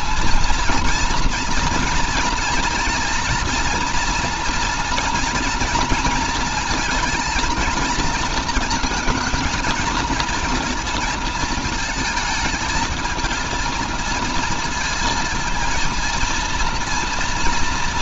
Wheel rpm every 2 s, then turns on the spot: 230, 230, 240, 220, 220, 230, 220, 230, 230.
none